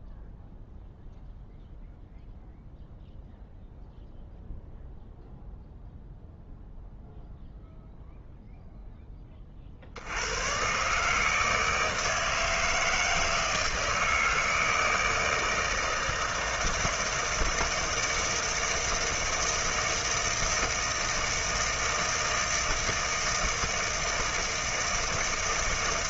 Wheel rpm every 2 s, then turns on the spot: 0, 0, 0, 0, 0, 130, 160, 160, 160, 160, 160, 160, 160.
none